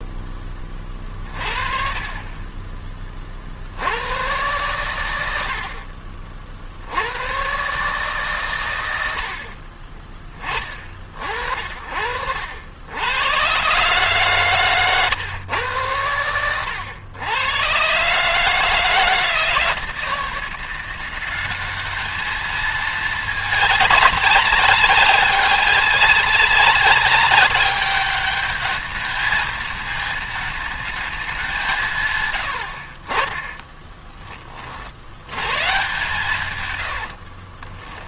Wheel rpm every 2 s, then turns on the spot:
20, 20, 110, 60, 110, 30, 80, 140, 110, 150, 170, 220, 200, 200, 210, 220, 70, 40, 100.
14-16 36-38